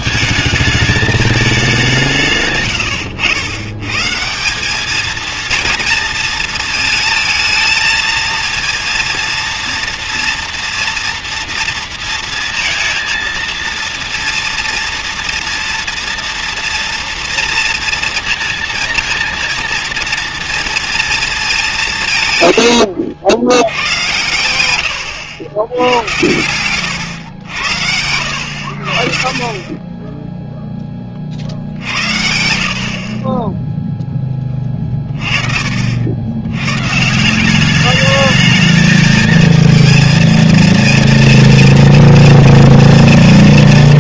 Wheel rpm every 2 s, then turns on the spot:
220, 130, 180, 220, 230, 240, 230, 230, 230, 230, 230, 120, 100, 110, 80, 0, 60, 20, 100, 210, 230, 230.
22-24